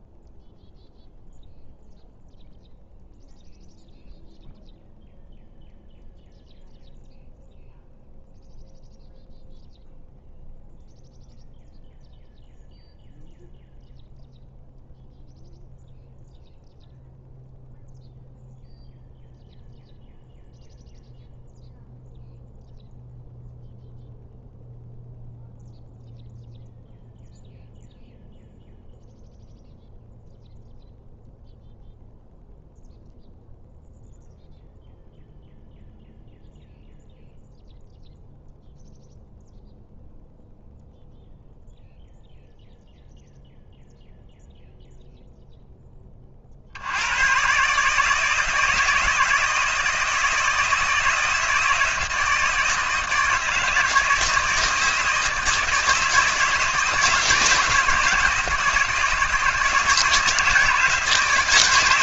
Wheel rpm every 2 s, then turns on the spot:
0, 0, 0, 0, 0, 0, 0, 0, 0, 0, 0, 0, 0, 0, 0, 0, 0, 0, 0, 0, 0, 0, 0, 80, 160, 160, 160, 160, 160, 160, 160.
none